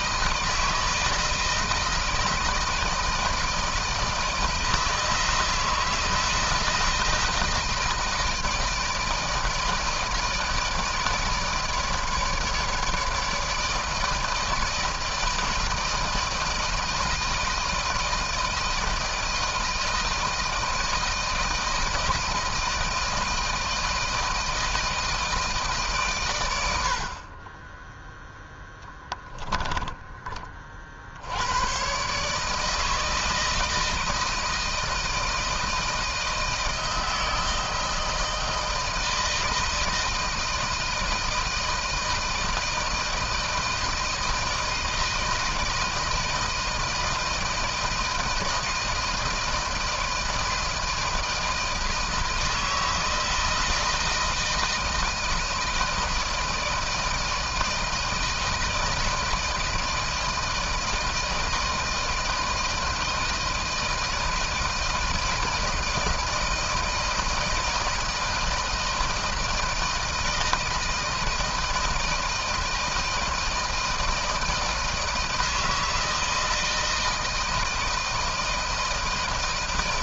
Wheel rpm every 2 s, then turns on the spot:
160, 160, 160, 160, 160, 160, 150, 160, 160, 160, 160, 160, 160, 130, 10, 20, 140, 160, 160, 160, 160, 160, 160, 160, 160, 160, 160, 160, 160, 160, 160, 160, 160, 160, 160, 160, 160, 160, 160, 170.
none